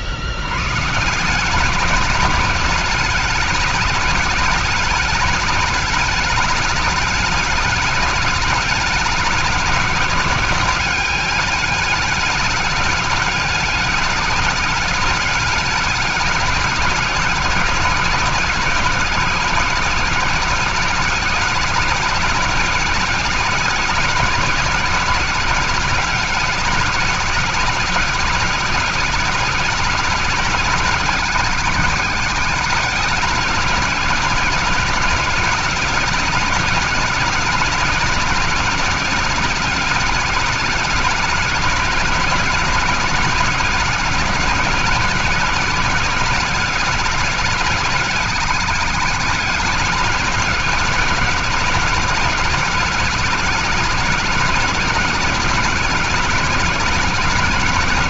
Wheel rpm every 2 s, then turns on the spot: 100, 200, 200, 210, 210, 200, 210, 200, 200, 190, 200, 200, 200, 200, 200, 200, 200, 190, 200, 200, 210, 190, 190, 200, 210, 190, 200, 200, 190.
none